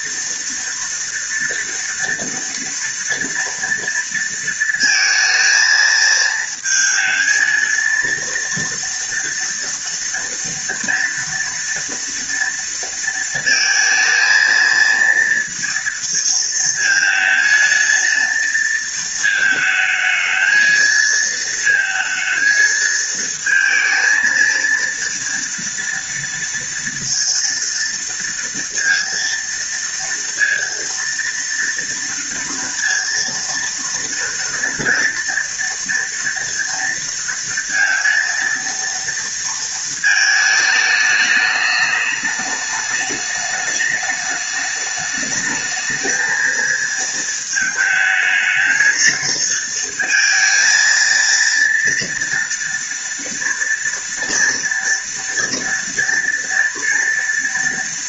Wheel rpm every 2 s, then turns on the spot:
230, 230, 220, 220, 230, 230, 230, 230, 230, 220, 220, 230, 230, 230, 230, 230, 230, 230, 230, 230, 210, 210, 210, 220, 220, 230, 230, 230, 230.
none